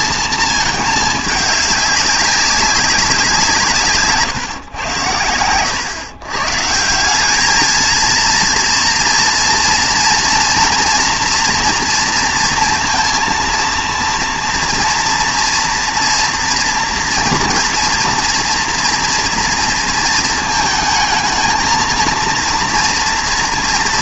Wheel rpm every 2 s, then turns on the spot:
220, 200, 140, 150, 230, 240, 230, 240, 230, 230, 220, 230.
none